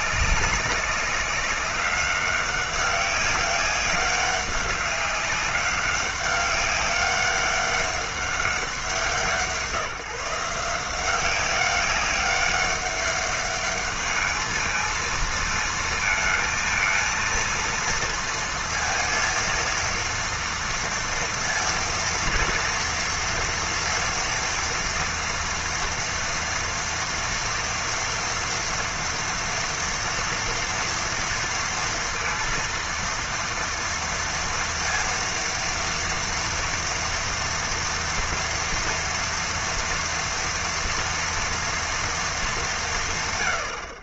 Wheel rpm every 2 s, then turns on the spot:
200, 200, 200, 200, 190, 170, 200, 220, 230, 230, 230, 230, 230, 230, 230, 230, 230, 230, 230, 230, 230, 230.
none